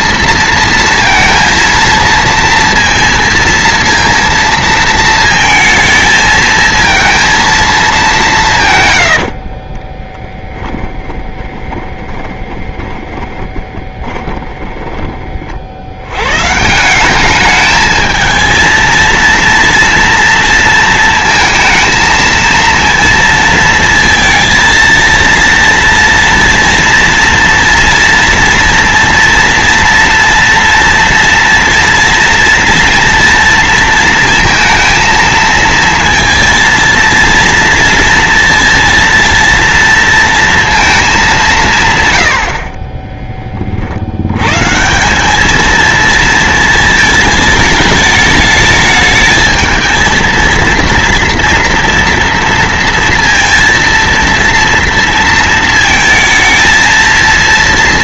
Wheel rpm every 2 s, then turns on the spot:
230, 230, 230, 220, 160, 10, 20, 10, 120, 230, 230, 230, 230, 230, 230, 230, 230, 230, 230, 230, 230, 110, 110, 230, 210, 230, 230, 230, 220.
10-16